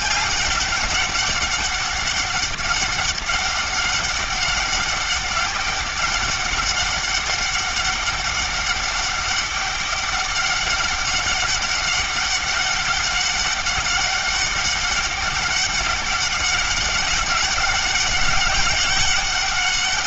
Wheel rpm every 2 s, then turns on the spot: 200, 200, 200, 200, 200, 200, 200, 200, 200, 200.
none